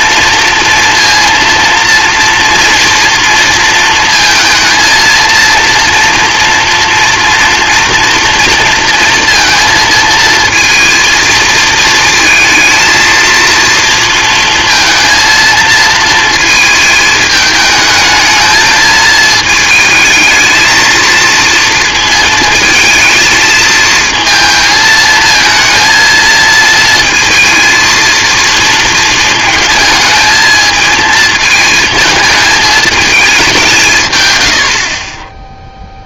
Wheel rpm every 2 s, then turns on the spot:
230, 230, 230, 240, 230, 220, 230, 230, 220, 220, 220, 220, 220, 220, 230, 220, 220, 60.
none